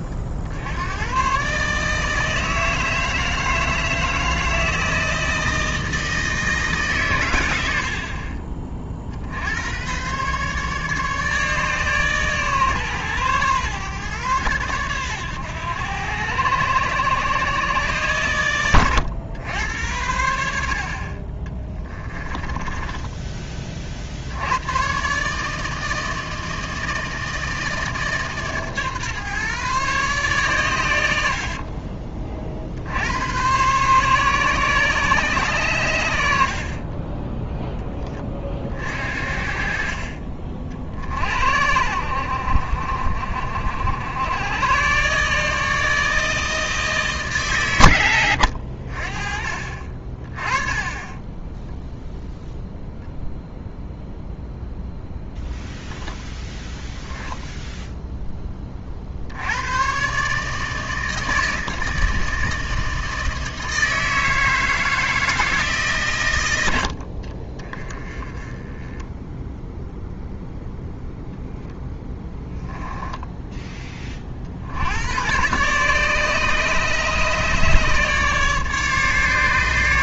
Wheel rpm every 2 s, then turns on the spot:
80, 160, 160, 150, 40, 140, 140, 110, 110, 110, 70, 10, 100, 160, 140, 120, 70, 130, 60, 40, 50, 60, 110, 160, 70, 40, 0, 0, 10, 20, 160, 160, 160, 80, 10, 0, 10, 70, 150, 150.
22-24 72-74